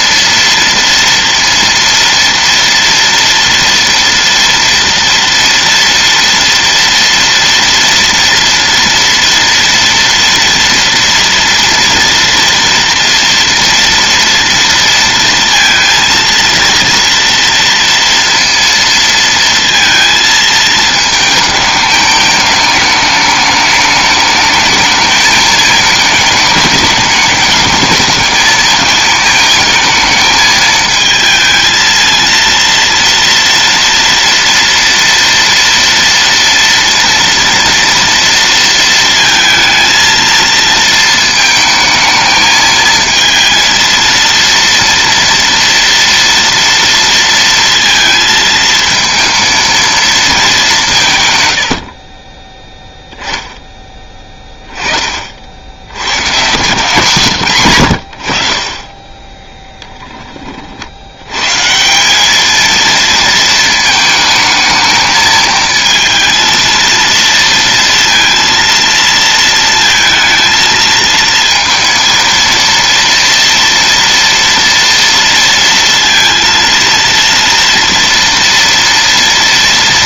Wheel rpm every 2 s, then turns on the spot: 230, 230, 230, 230, 230, 230, 230, 230, 230, 230, 220, 210, 220, 210, 220, 220, 230, 230, 230, 230, 230, 220, 230, 230, 220, 190, 10, 20, 120, 40, 50, 220, 220, 230, 230, 230, 230, 230, 230, 230.
none